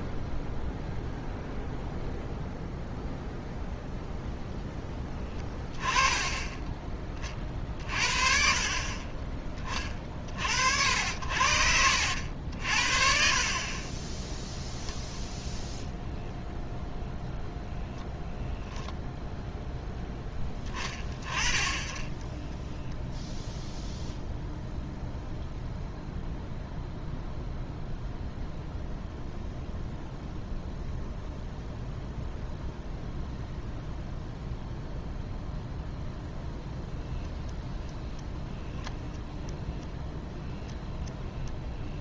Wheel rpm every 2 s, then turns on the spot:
0, 0, 10, 20, 40, 60, 50, 0, 0, 0, 20, 10, 0, 0, 0, 0, 0, 0, 0, 0, 0.
22-24